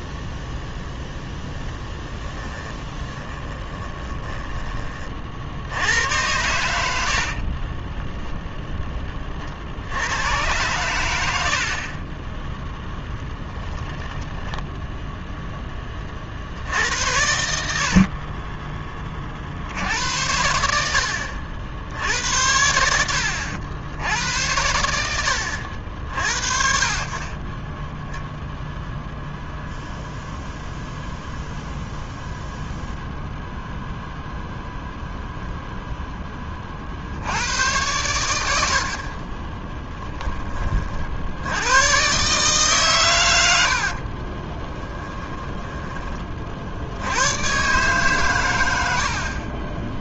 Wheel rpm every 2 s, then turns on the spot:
0, 10, 30, 90, 10, 100, 10, 10, 80, 30, 80, 80, 80, 40, 0, 0, 0, 0, 50, 60, 40, 130, 10, 60, 80.
6-8 12-14 44-46